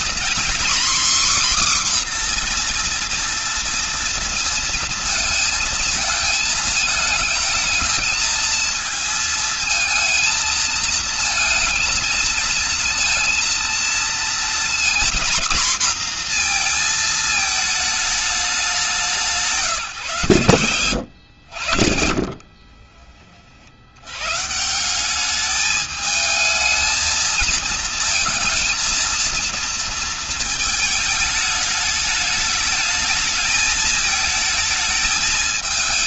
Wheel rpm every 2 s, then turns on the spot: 260, 240, 230, 220, 220, 230, 230, 240, 230, 190, 100, 40, 190, 220, 230, 220, 210, 220.
20-22